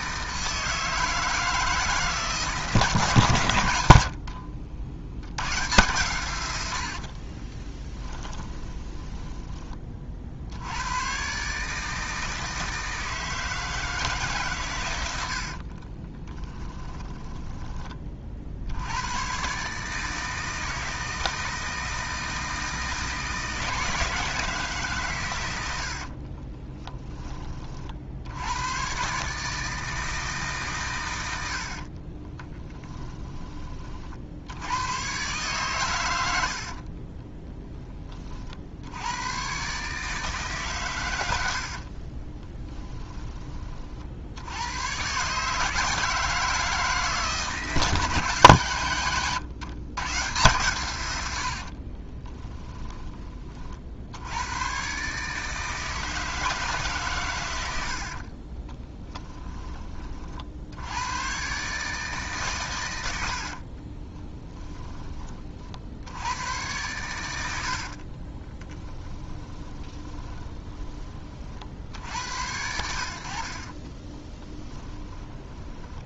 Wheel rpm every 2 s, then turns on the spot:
160, 130, 70, 70, 20, 100, 160, 110, 20, 70, 160, 160, 140, 20, 110, 130, 20, 110, 50, 80, 130, 10, 110, 160, 130, 120, 10, 120, 150, 20, 80, 110, 10, 100, 10, 20, 80, 10.
6-10 16-18 26-28 32-34 42-44 58-60 68-72 74-76